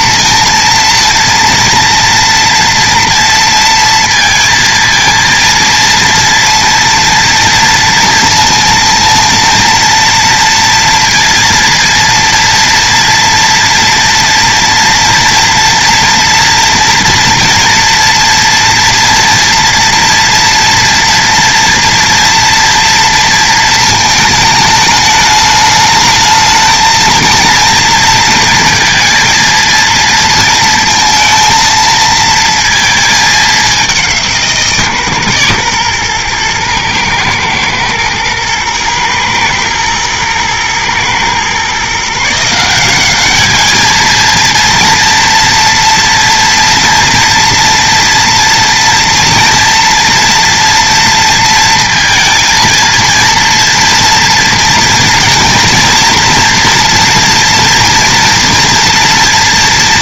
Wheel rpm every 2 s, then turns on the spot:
230, 230, 220, 230, 230, 230, 230, 230, 240, 230, 230, 230, 210, 220, 230, 230, 230, 150, 110, 110, 120, 190, 230, 230, 230, 230, 230, 230, 230, 230.
none